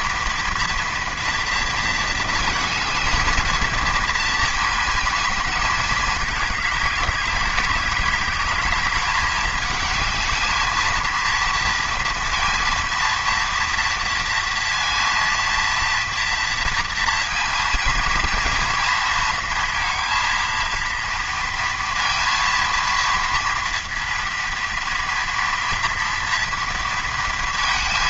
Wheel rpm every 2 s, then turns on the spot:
230, 220, 220, 200, 210, 220, 230, 230, 230, 230, 230, 230, 230, 230.
none